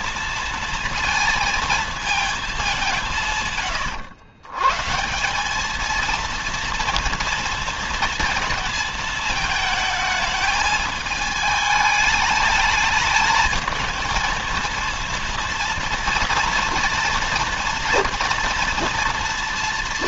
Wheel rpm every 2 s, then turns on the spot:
230, 180, 170, 230, 220, 220, 220, 230, 230, 230.
none